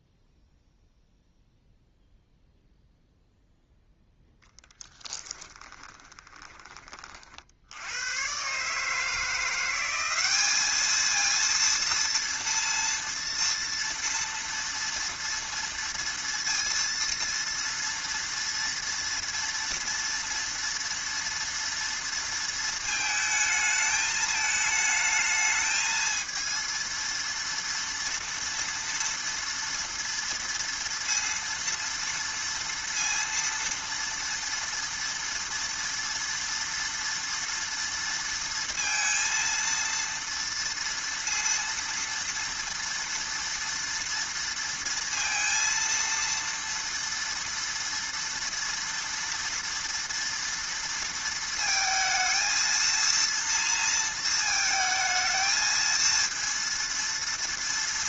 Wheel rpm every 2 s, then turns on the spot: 0, 0, 10, 30, 140, 210, 230, 230, 230, 230, 230, 220, 220, 230, 230, 230, 230, 230, 230, 230, 230, 230, 230, 230, 230, 230, 230, 220, 230.
4-6